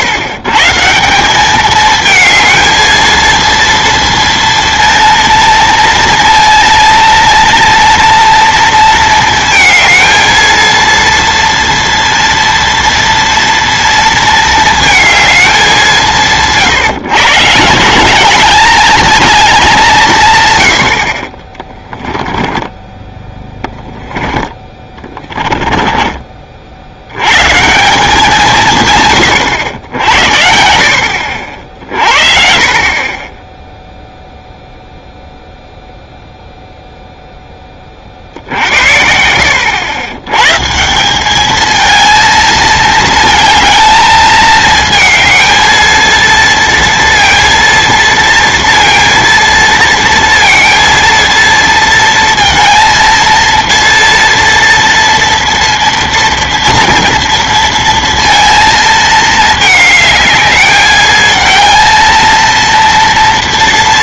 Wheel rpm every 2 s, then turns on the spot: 130, 220, 230, 230, 230, 230, 230, 220, 140, 200, 90, 20, 10, 40, 120, 70, 40, 0, 0, 50, 140, 220, 220, 230, 230, 230, 230, 230, 230, 230, 210, 230.
22-24